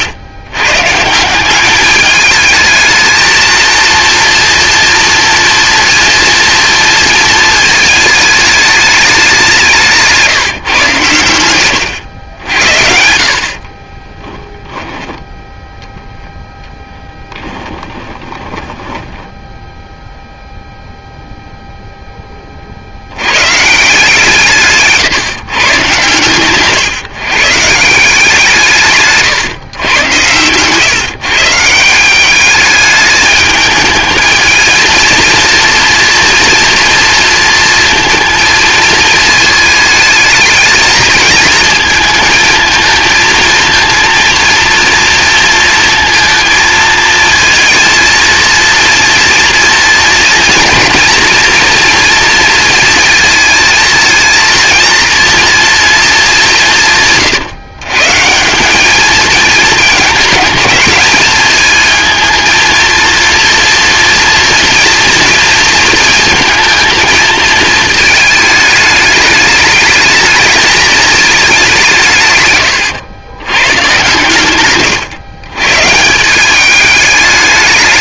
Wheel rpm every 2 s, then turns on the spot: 150, 220, 230, 230, 200, 130, 70, 10, 10, 10, 0, 50, 150, 140, 150, 130, 210, 220, 230, 220, 220, 220, 230, 230, 230, 230, 230, 230, 160, 200, 220, 230, 240, 230, 210, 220, 120, 130, 200.
18-20 24-26 72-76